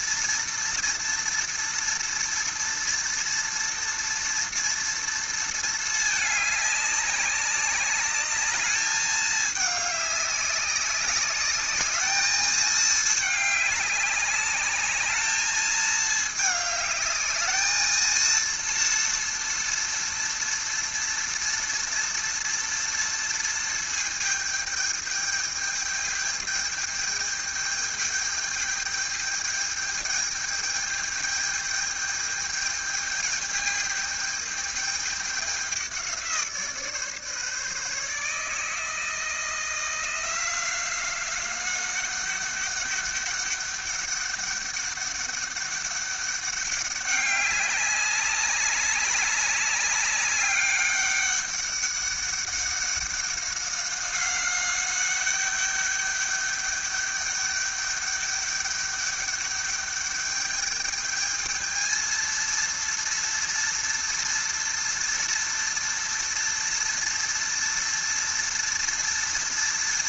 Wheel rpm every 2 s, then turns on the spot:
230, 230, 230, 200, 210, 190, 220, 200, 210, 230, 230, 230, 210, 210, 210, 210, 210, 210, 160, 160, 180, 200, 200, 200, 190, 200, 200, 190, 200, 200, 210, 230, 240, 230, 230.
none